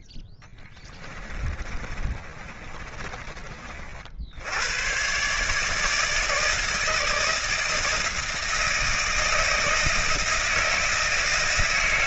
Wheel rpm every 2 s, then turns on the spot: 10, 30, 120, 160, 160, 160.
0-4